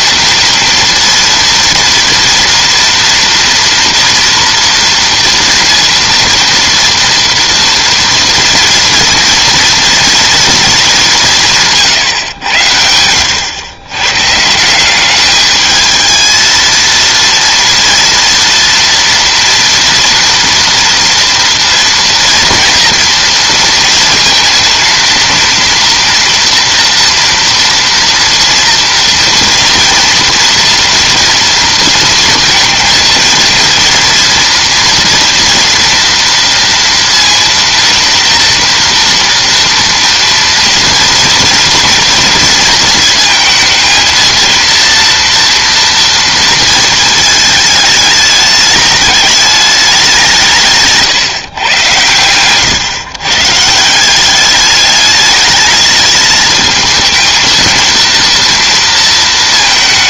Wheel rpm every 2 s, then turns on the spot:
230, 240, 230, 230, 230, 220, 100, 160, 230, 230, 230, 230, 230, 230, 230, 230, 230, 230, 230, 230, 230, 230, 230, 230, 210, 160, 120, 200, 220, 230.
none